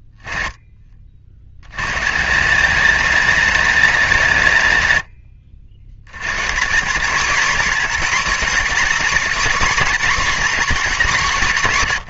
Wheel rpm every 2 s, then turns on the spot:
20, 200, 140, 150, 250, 220.
none